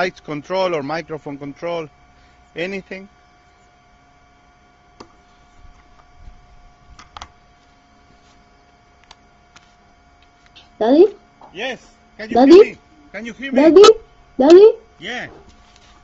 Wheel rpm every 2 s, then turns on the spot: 0, 0, 0, 0, 0, 0, 0, 0.
none